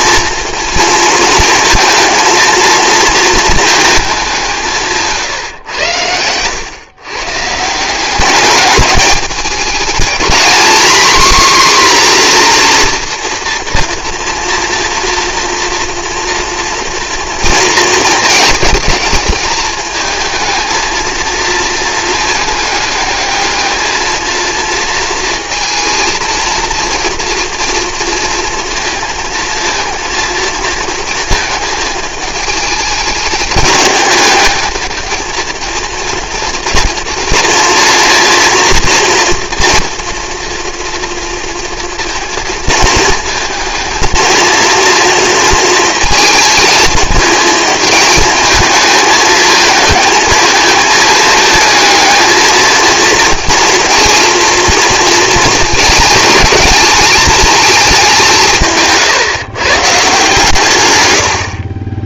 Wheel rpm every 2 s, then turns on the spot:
230, 230, 170, 120, 200, 240, 240, 230, 230, 210, 220, 210, 230, 230, 230, 230, 210, 210, 230, 230, 230, 230, 230, 220, 220, 220, 220, 230, 220, 170, 140.
none